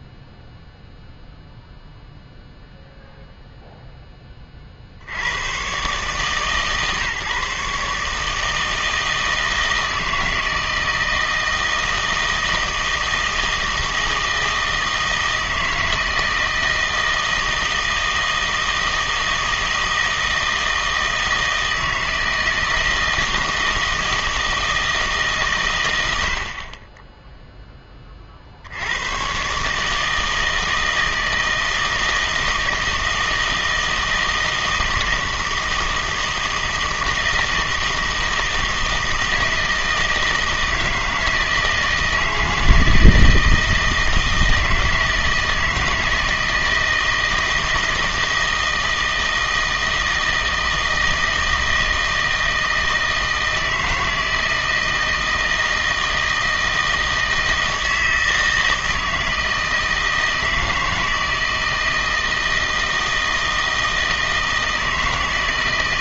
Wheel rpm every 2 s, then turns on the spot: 0, 0, 40, 140, 160, 160, 160, 160, 160, 160, 160, 160, 160, 40, 70, 160, 160, 160, 160, 160, 160, 160, 160, 160, 160, 160, 160, 160, 160, 160, 160, 160, 160.
none